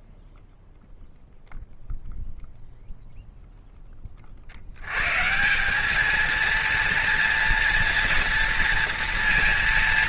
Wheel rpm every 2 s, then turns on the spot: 0, 10, 190, 230, 230.
none